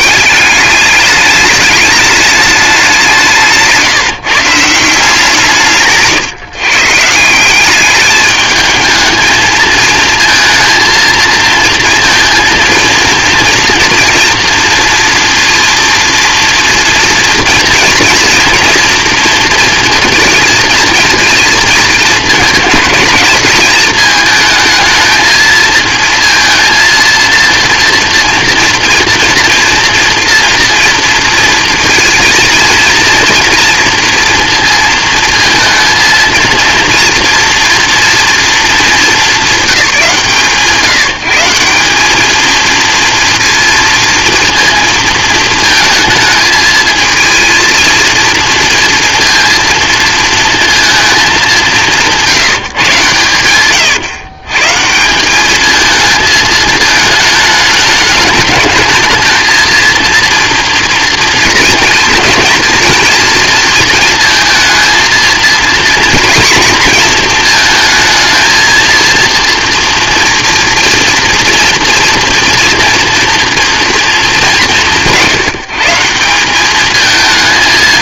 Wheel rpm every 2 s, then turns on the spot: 200, 200, 160, 150, 220, 230, 230, 230, 230, 230, 230, 220, 220, 230, 230, 230, 230, 230, 230, 220, 170, 230, 230, 220, 230, 230, 140, 160, 220, 220, 230, 220, 230, 230, 230, 230, 230, 180, 210.
none